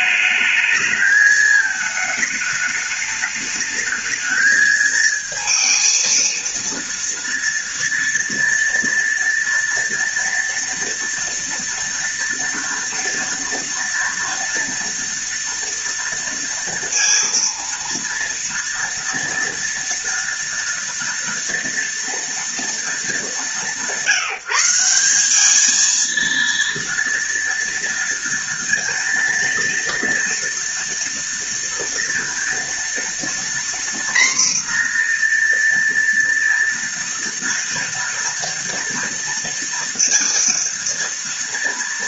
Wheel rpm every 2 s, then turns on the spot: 220, 210, 220, 230, 230, 230, 230, 230, 230, 230, 230, 200, 200, 230, 230, 240, 240, 240, 230, 230, 230.
none